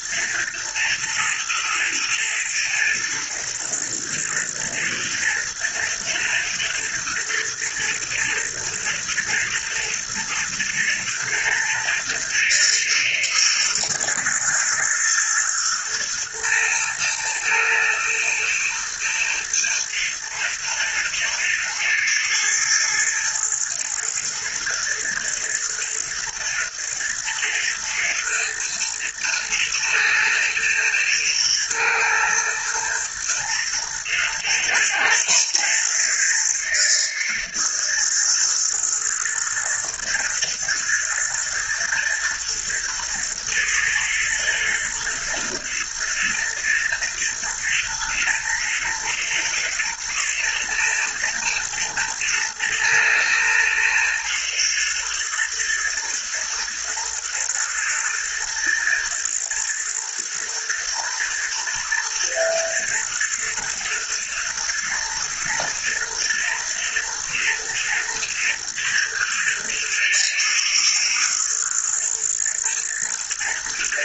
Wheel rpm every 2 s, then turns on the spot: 110, 110, 110, 120, 120, 120, 120, 110, 120, 110, 110, 110, 110, 110, 120, 110, 120, 110, 120, 110, 120, 120, 120, 120, 110, 110, 120, 120, 120, 110, 110, 120, 110, 110, 120, 110, 110.
none